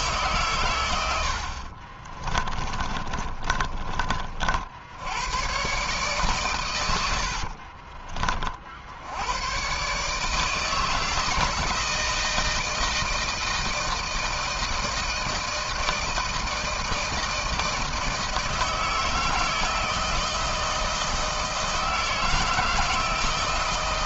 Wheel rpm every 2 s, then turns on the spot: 100, 30, 80, 90, 70, 160, 160, 160, 160, 160, 160, 160.
2-4 6-8